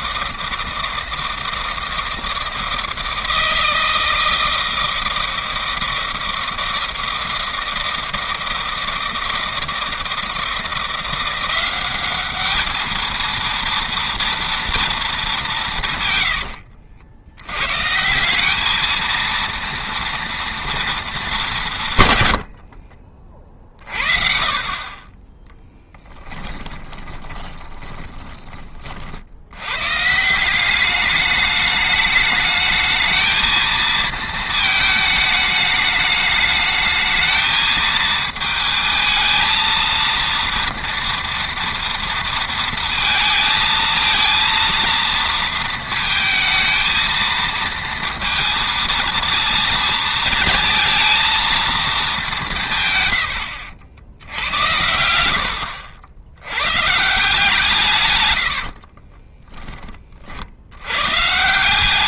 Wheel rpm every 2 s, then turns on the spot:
160, 160, 160, 160, 160, 170, 210, 230, 80, 220, 230, 60, 30, 10, 40, 200, 210, 220, 220, 220, 230, 230, 230, 220, 230, 230, 130, 90, 130, 50, 90.
22-24 26-28 58-60